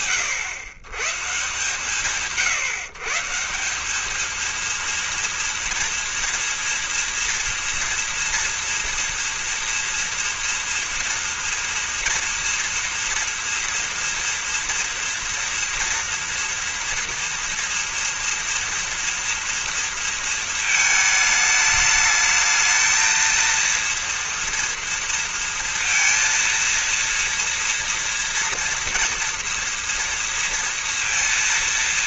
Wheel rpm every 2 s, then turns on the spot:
120, 160, 230, 230, 230, 230, 230, 230, 240, 230, 210, 230, 230, 230, 230, 230.
none